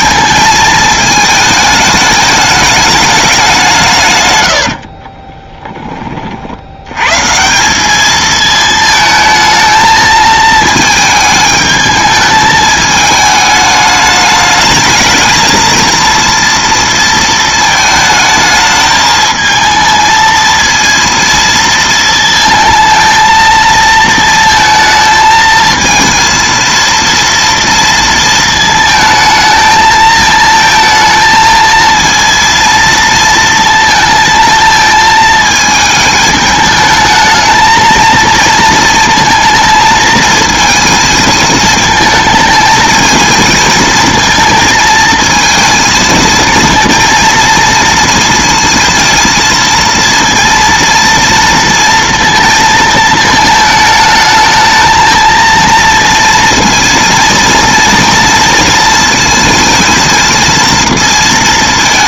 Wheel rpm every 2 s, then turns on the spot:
220, 210, 70, 80, 220, 220, 220, 210, 230, 220, 230, 230, 220, 230, 220, 220, 230, 220, 210, 230, 220, 220, 230, 230, 230, 230, 230, 220, 230, 230, 230.
4-6